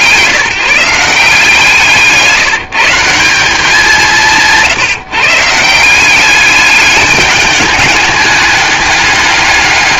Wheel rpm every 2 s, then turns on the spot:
170, 160, 160, 210, 200.
none